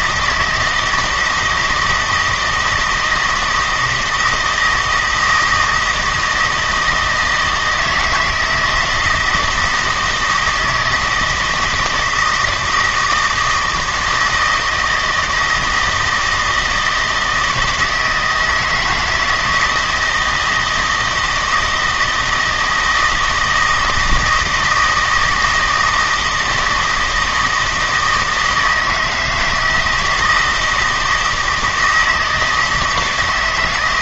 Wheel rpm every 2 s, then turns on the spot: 160, 160, 160, 160, 160, 160, 160, 160, 160, 160, 160, 160, 160, 160, 160, 160, 160.
none